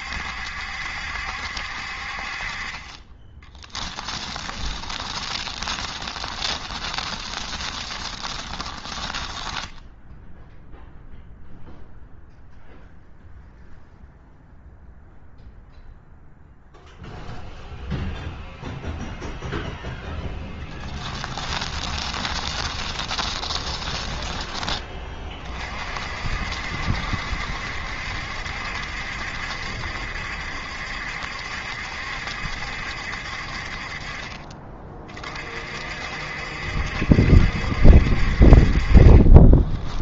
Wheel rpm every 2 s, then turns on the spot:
70, 30, 20, 20, 20, 0, 0, 0, 0, 0, 10, 20, 20, 70, 70, 70, 70, 30, 70, 40.
4-10 20-24 38-40